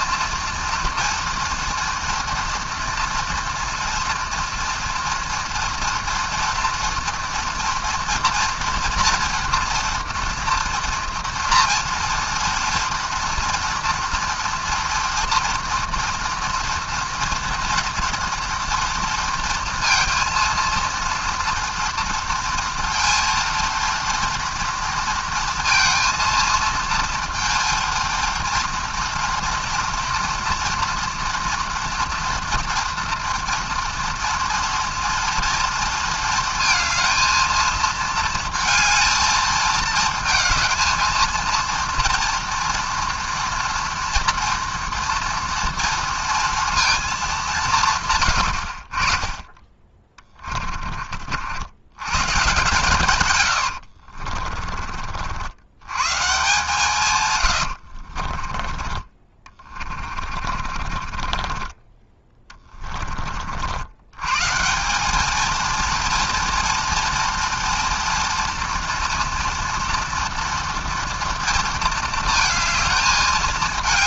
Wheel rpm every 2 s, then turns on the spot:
230, 230, 230, 230, 230, 230, 240, 240, 230, 230, 230, 230, 230, 230, 230, 230, 230, 230, 220, 220, 230, 240, 230, 230, 60, 30, 150, 40, 140, 20, 30, 20, 160, 230, 230, 230, 220.
50-52 58-64